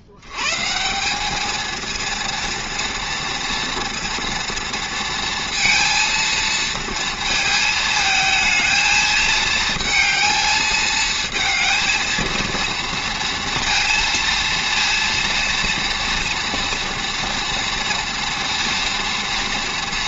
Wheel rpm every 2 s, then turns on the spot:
150, 230, 230, 220, 220, 220, 230, 230, 230, 230.
none